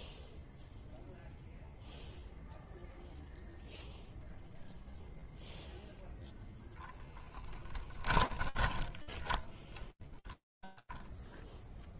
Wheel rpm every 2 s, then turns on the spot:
0, 0, 0, 10, 10, 10.
8-12